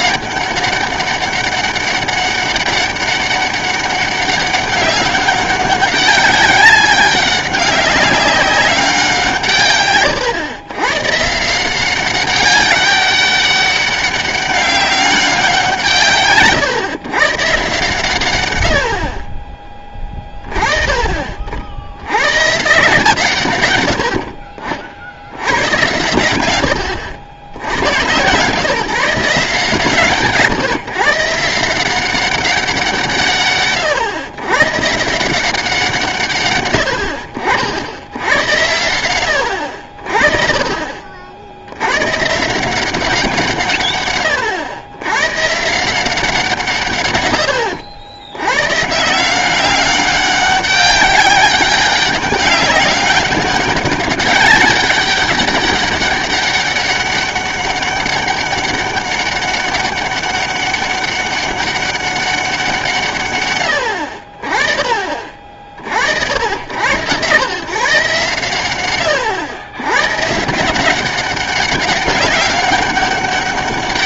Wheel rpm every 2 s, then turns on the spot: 200, 200, 200, 200, 200, 120, 200, 200, 130, 80, 30, 150, 50, 100, 150, 140, 180, 140, 100, 100, 50, 170, 100, 140, 140, 200, 200, 200, 200, 200, 200, 180, 30, 90, 110, 170, 190.
none